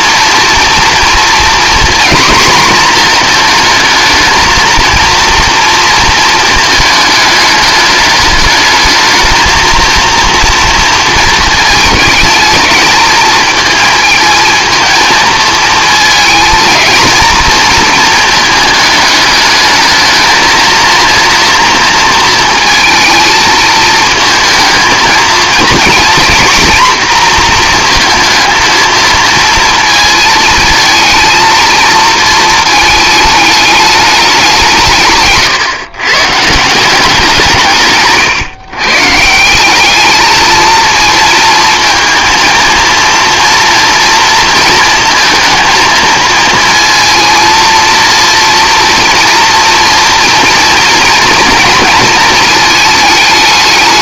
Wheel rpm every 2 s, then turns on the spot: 230, 230, 230, 220, 210, 230, 210, 220, 230, 210, 230, 220, 220, 240, 230, 230, 220, 170, 170, 130, 220, 230, 230, 230, 230, 230, 220.
none